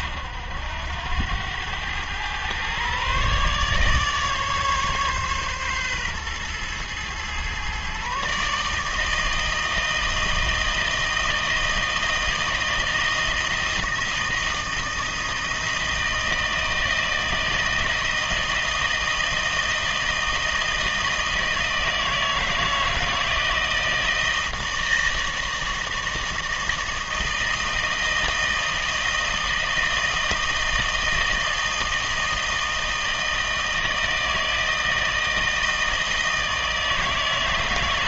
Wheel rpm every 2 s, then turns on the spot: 90, 130, 140, 120, 160, 160, 160, 160, 160, 160, 160, 160, 160, 160, 160, 160, 160, 160, 160.
none